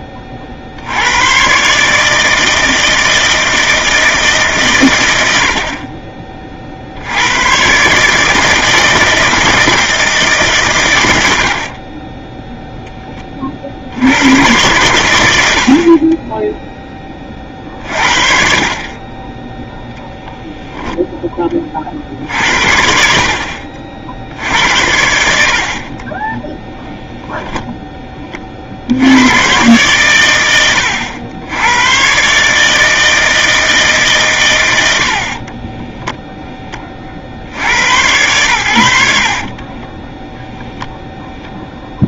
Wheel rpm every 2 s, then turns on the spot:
50, 160, 140, 50, 160, 140, 0, 100, 10, 50, 0, 60, 70, 0, 40, 100, 150, 100, 10, 100, 0.
none